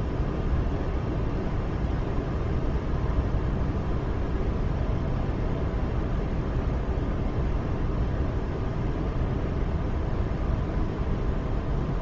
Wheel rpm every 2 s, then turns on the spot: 0, 0, 0, 0, 0, 0.
none